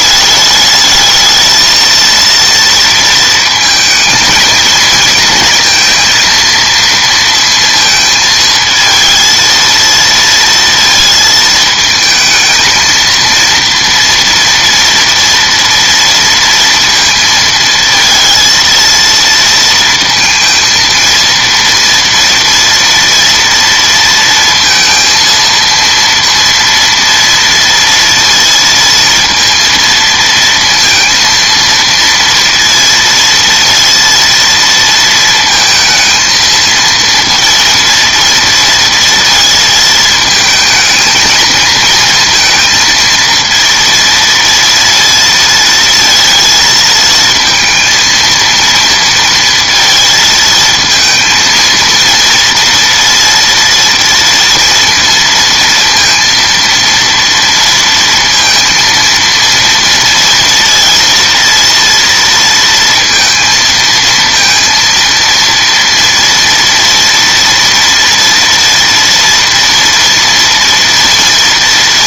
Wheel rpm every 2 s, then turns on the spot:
210, 230, 220, 230, 220, 230, 220, 230, 230, 230, 230, 230, 230, 230, 230, 230, 230, 230, 230, 230, 220, 230, 230, 230, 230, 220, 230, 230, 230, 230, 230, 230, 230, 230, 230, 230.
none